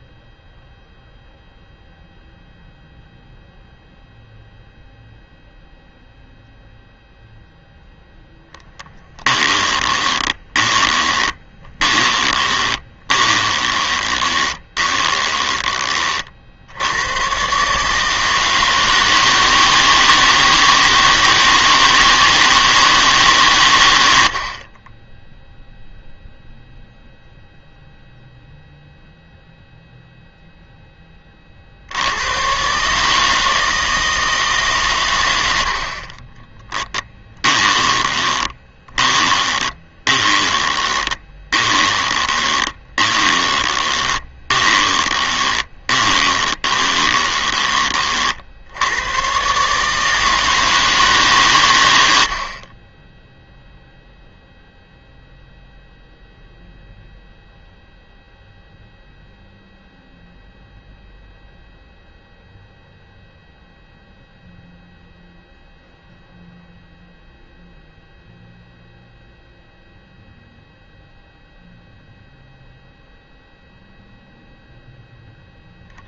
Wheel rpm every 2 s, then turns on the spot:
0, 0, 0, 0, 10, 20, 20, 20, 90, 160, 160, 160, 20, 0, 0, 10, 140, 130, 10, 20, 20, 20, 20, 20, 90, 160, 30, 0, 0, 0, 0, 0, 0, 0, 0, 0, 0, 0.
8-16 36-48